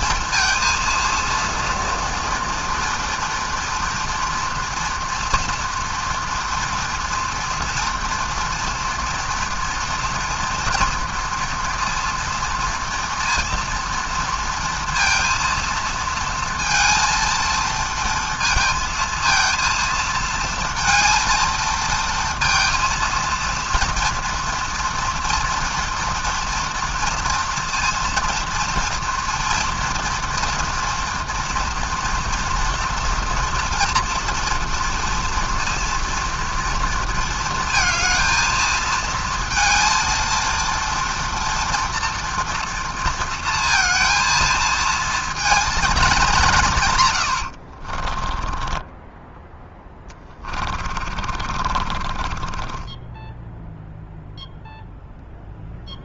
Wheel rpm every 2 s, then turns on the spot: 230, 230, 230, 230, 230, 230, 230, 230, 230, 230, 230, 230, 230, 230, 230, 230, 230, 230, 230, 220, 230, 230, 230, 170, 20, 20, 20, 0.
48-54